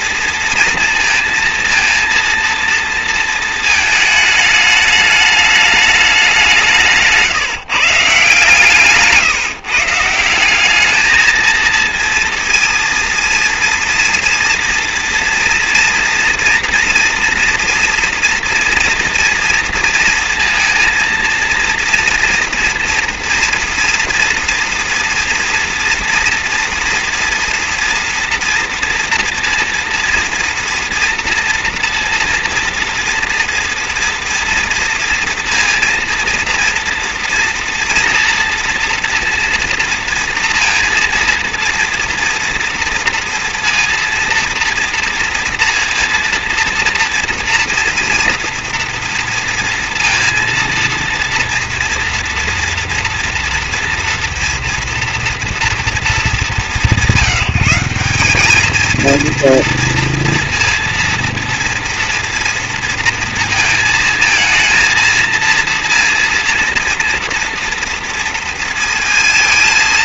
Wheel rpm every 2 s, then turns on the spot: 230, 230, 220, 190, 150, 180, 230, 240, 240, 240, 230, 240, 230, 230, 230, 240, 230, 230, 230, 230, 230, 230, 230, 230, 230, 230, 230, 230, 210, 210, 230, 230, 230, 230, 230.
none